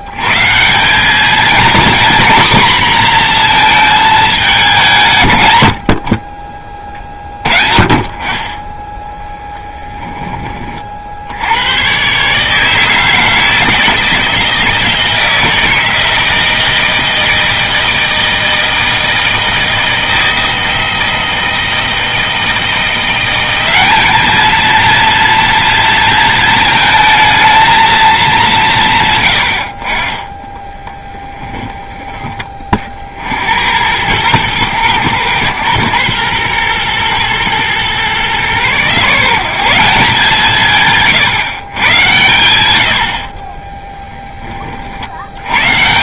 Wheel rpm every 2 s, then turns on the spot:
110, 240, 210, 40, 30, 30, 150, 160, 160, 160, 160, 170, 220, 220, 180, 10, 40, 110, 120, 130, 160, 90, 60.
30-32